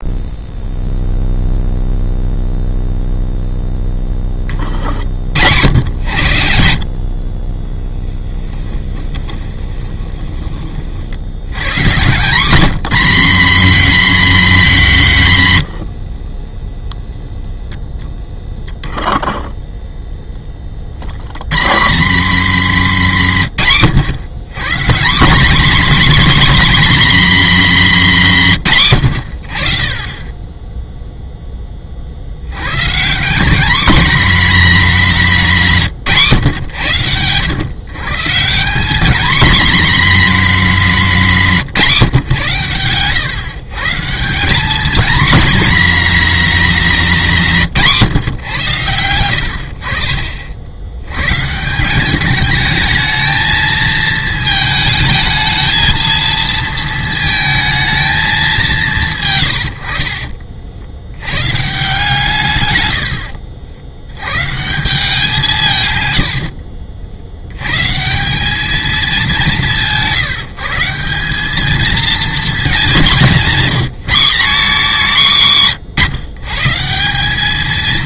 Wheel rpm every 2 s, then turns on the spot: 0, 0, 20, 70, 20, 40, 210, 220, 10, 0, 10, 120, 160, 270, 180, 10, 120, 230, 120, 200, 220, 130, 190, 200, 100, 70, 210, 220, 230, 200, 60, 120, 150, 70, 210, 160, 190, 220, 150.
8-10 16-18 22-24 66-68